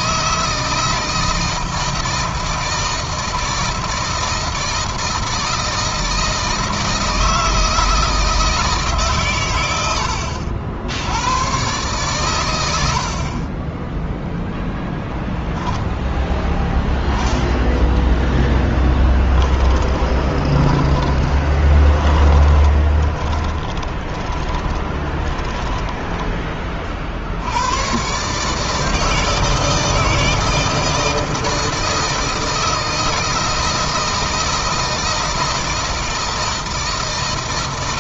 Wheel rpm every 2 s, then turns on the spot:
160, 160, 160, 160, 150, 80, 70, 0, 0, 10, 20, 10, 20, 40, 150, 160, 160, 160, 160.
20-26